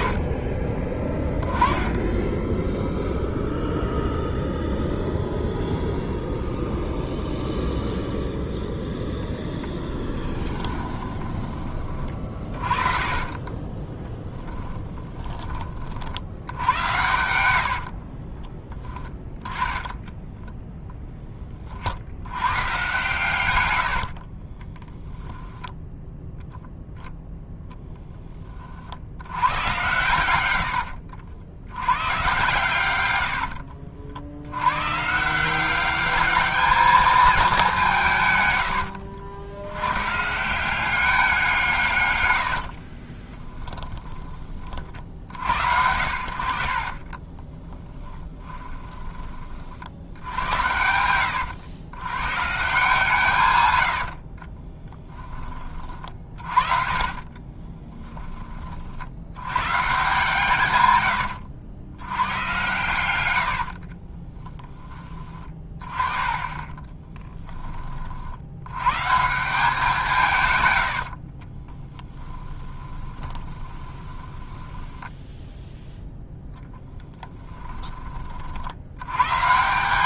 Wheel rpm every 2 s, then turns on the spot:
20, 0, 0, 0, 0, 20, 30, 10, 90, 10, 10, 120, 20, 10, 50, 90, 110, 120, 210, 100, 180, 50, 50, 40, 20, 80, 150, 20, 40, 50, 120, 120, 10, 20, 110, 90, 10, 10, 10, 80.
10-16 18-20 24-26 30-32 42-44 46-50 54-58 66-68 70-78